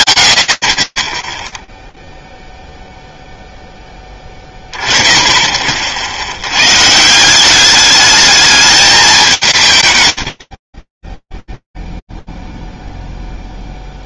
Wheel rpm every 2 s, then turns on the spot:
40, 0, 10, 110, 210, 40, 0.
none